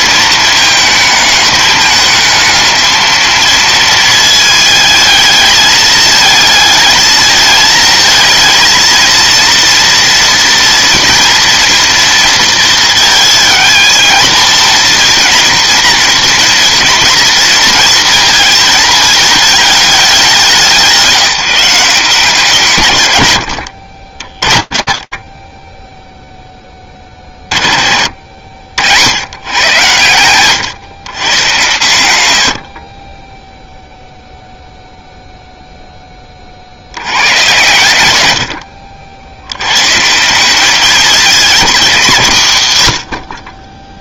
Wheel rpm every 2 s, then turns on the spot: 220, 220, 220, 220, 230, 240, 230, 220, 230, 230, 190, 170, 40, 20, 90, 140, 40, 0, 90, 100, 210, 90.
none